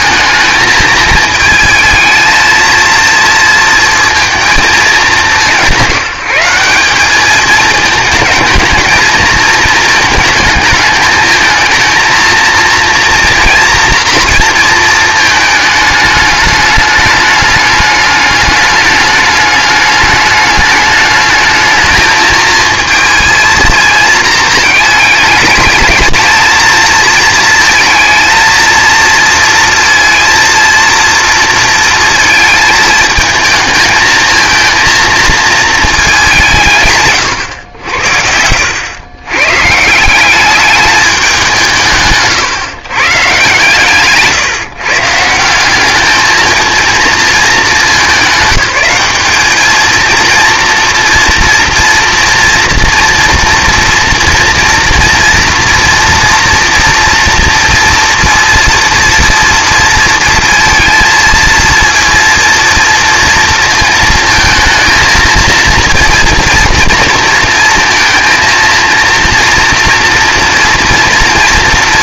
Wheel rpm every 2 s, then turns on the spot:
220, 230, 220, 180, 220, 210, 230, 230, 210, 210, 210, 220, 220, 230, 230, 230, 220, 230, 160, 100, 200, 140, 150, 220, 210, 230, 230, 230, 230, 230, 220, 230, 220, 230, 230, 230.
none